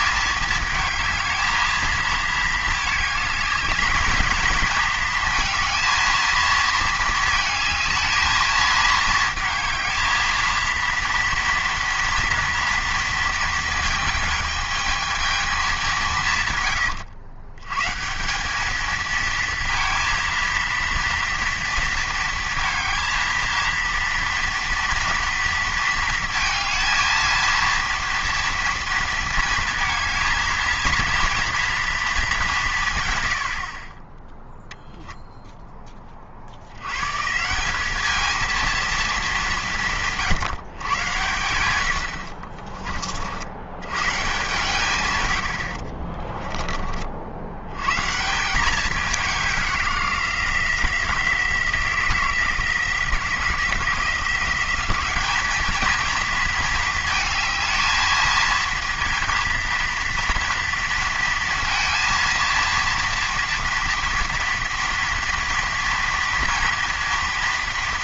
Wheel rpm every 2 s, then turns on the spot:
220, 220, 220, 220, 220, 230, 230, 220, 130, 210, 230, 230, 230, 230, 230, 220, 170, 0, 70, 230, 130, 40, 140, 30, 180, 170, 170, 190, 230, 220, 230, 230, 230, 230.
42-44